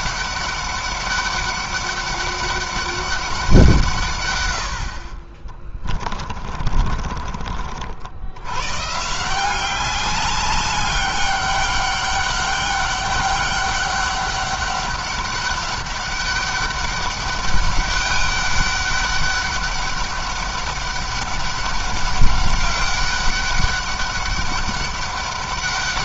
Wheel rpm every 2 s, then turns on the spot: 200, 200, 80, 30, 120, 200, 200, 200, 200, 200, 200, 200, 200.
6-8